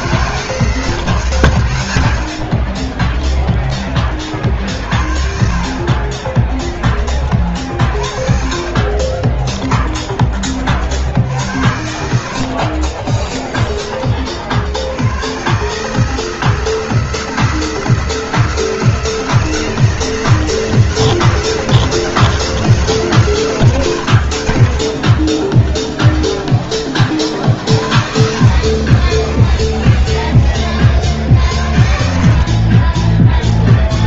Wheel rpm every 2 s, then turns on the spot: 160, 50, 50, 30, 50, 60, 50, 80, 160, 160, 160, 160, 50, 20, 40, 50, 60.
2-4 6-10 12-14 28-30 32-34